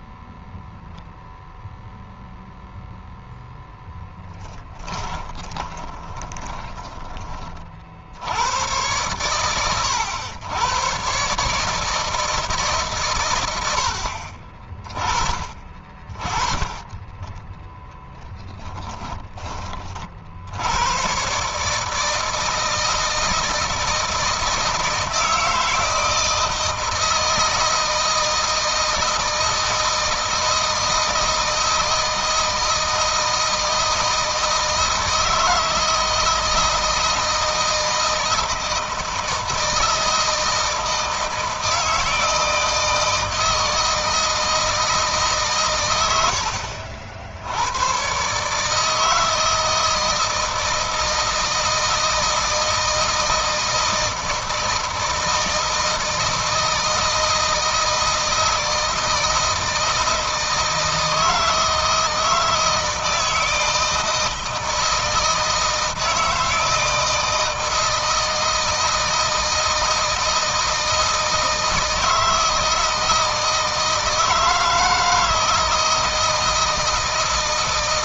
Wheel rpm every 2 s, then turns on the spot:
0, 0, 20, 10, 100, 110, 140, 30, 30, 10, 90, 160, 160, 160, 160, 160, 160, 160, 160, 160, 160, 160, 160, 70, 150, 170, 160, 160, 160, 160, 160, 160, 160, 160, 160, 160, 160, 160, 160.
4-8 18-20